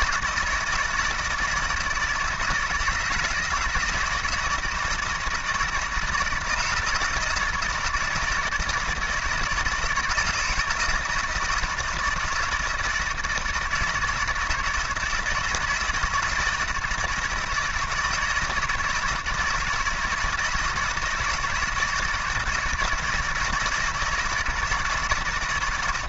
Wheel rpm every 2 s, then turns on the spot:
160, 160, 170, 160, 160, 160, 160, 160, 170, 160, 160, 160, 160.
none